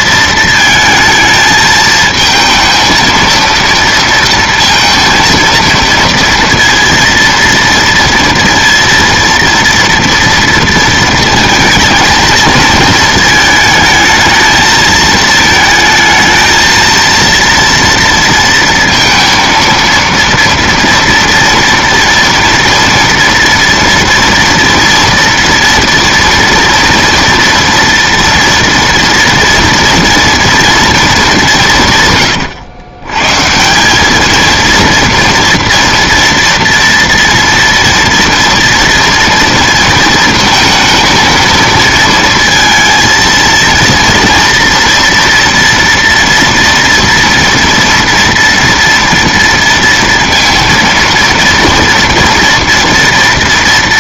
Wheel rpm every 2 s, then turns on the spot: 230, 230, 230, 230, 230, 230, 230, 220, 220, 230, 230, 230, 230, 240, 230, 240, 110, 220, 230, 230, 230, 230, 230, 230, 230, 230, 230.
none